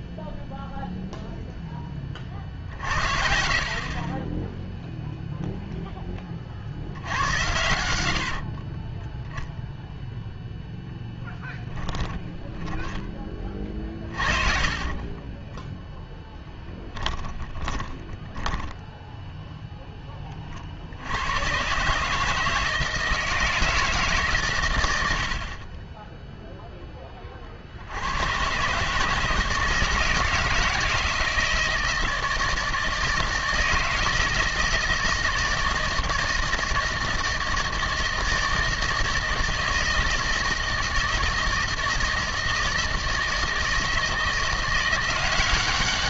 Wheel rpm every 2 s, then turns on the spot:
0, 70, 10, 60, 40, 0, 10, 30, 10, 10, 50, 160, 120, 0, 130, 160, 160, 160, 160, 160, 160, 160, 170.
8-10 14-18